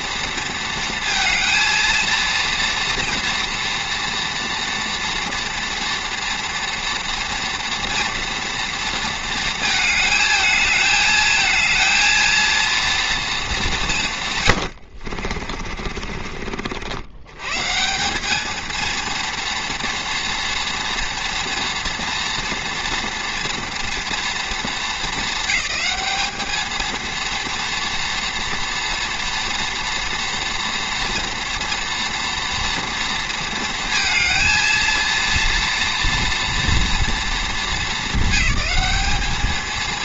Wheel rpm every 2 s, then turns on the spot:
230, 230, 230, 230, 230, 220, 230, 110, 60, 230, 230, 230, 230, 220, 230, 230, 230, 230, 230, 200.
14-16